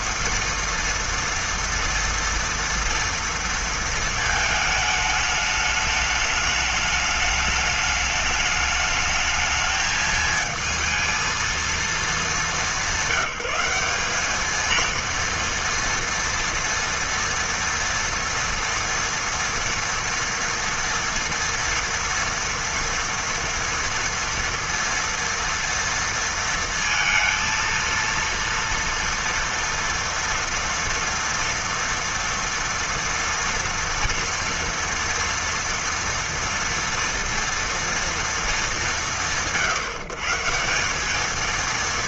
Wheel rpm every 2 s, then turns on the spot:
230, 230, 220, 210, 210, 220, 200, 220, 230, 230, 230, 230, 230, 230, 230, 230, 230, 230, 230, 200, 170.
none